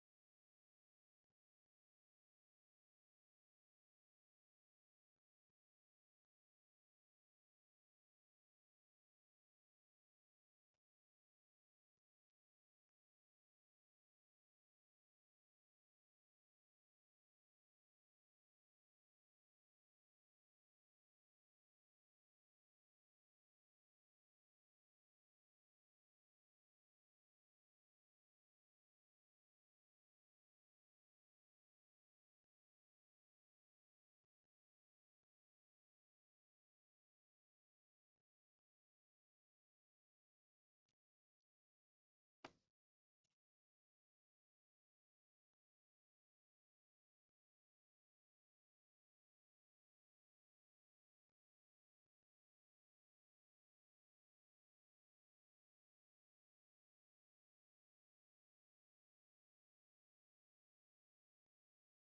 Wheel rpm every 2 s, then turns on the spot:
0, 0, 0, 0, 0, 0, 0, 0, 0, 0, 0, 0, 0, 0, 0, 0, 0, 0, 0, 0, 0, 0, 0, 0, 0, 0, 0, 0, 0, 0, 0.
none